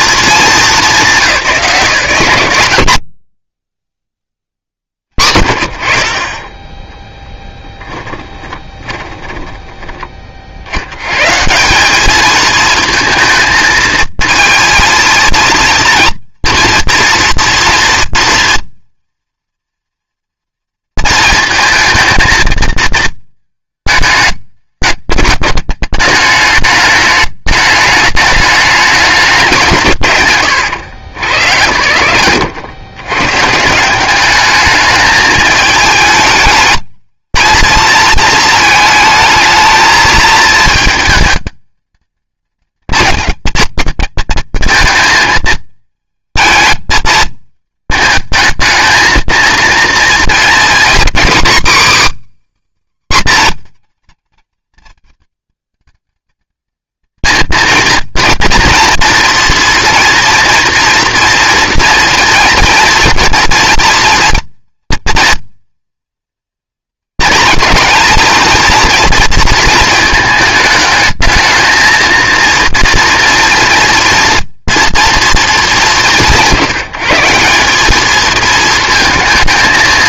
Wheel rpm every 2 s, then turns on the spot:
220, 90, 50, 20, 20, 70, 220, 230, 230, 240, 230, 220, 210, 210, 210, 130, 90, 210, 220, 220, 220, 220, 230, 220, 220, 240, 290, 220, 220, 230, 230, 230, 240, 230, 230, 220, 230, 230, 150, 230.
8-10